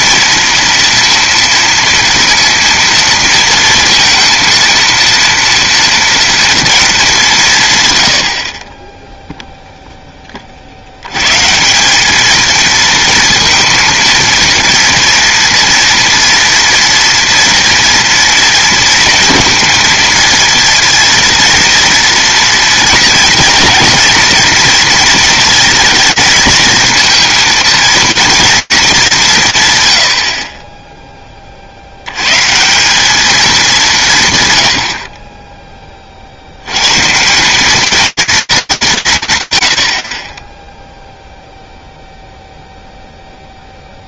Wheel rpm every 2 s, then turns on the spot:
230, 230, 230, 230, 40, 50, 220, 230, 240, 230, 230, 230, 230, 220, 230, 30, 170, 90, 100, 220, 20, 0.
none